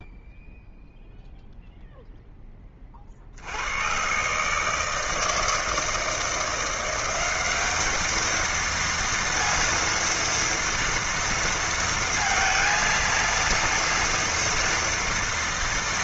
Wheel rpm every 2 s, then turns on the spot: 0, 10, 140, 170, 220, 230, 230, 230.
none